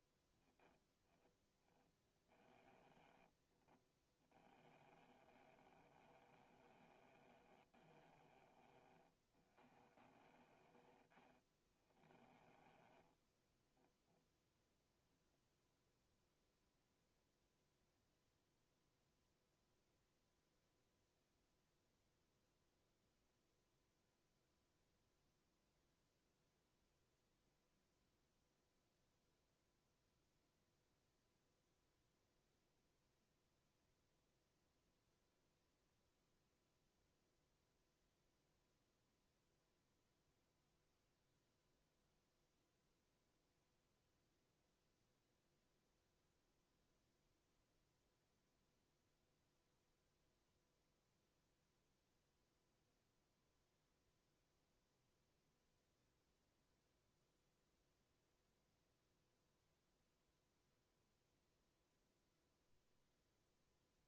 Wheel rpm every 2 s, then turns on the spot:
10, 20, 30, 30, 20, 20, 20, 0, 0, 0, 0, 0, 0, 0, 0, 0, 0, 0, 0, 0, 0, 0, 0, 0, 0, 0, 0, 0, 0, 0, 0, 0.
2-10 12-14